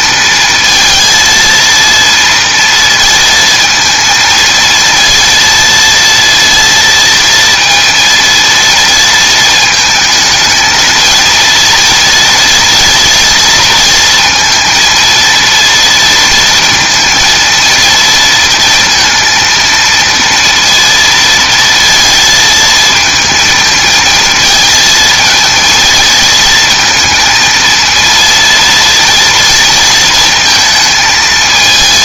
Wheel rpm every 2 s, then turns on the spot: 230, 230, 230, 230, 230, 220, 230, 230, 230, 230, 230, 220, 220, 230, 230, 220.
none